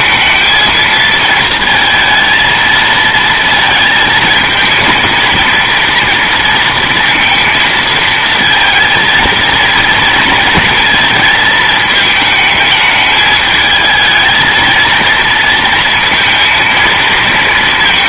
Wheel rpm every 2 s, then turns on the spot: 220, 220, 220, 230, 220, 220, 220, 230, 230.
none